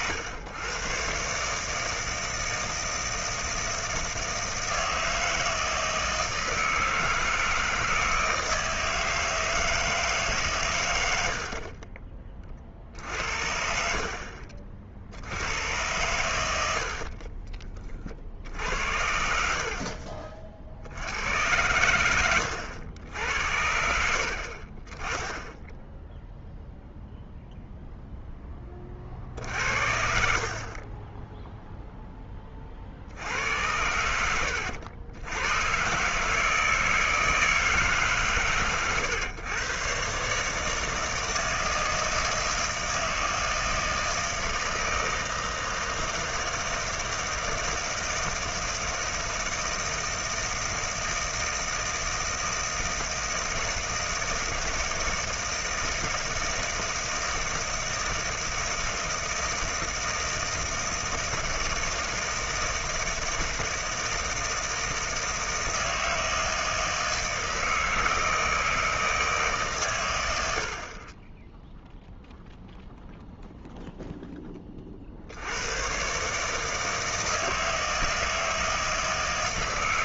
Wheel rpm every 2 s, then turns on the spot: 90, 160, 160, 160, 160, 130, 40, 40, 90, 70, 50, 90, 40, 0, 20, 40, 30, 80, 160, 130, 150, 160, 160, 160, 160, 160, 160, 160, 160, 160, 160, 160, 160, 160, 160, 60, 0, 20, 150, 160.
18-20